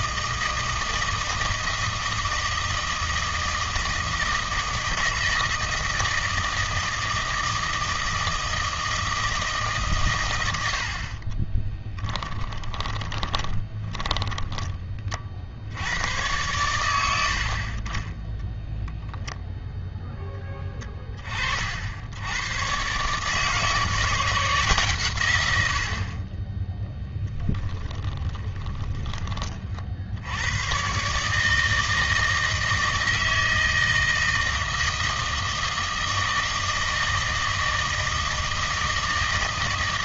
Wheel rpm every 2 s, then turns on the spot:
160, 160, 160, 160, 160, 80, 20, 30, 100, 0, 10, 130, 150, 10, 10, 110, 160, 160, 160, 160.
12-14 28-30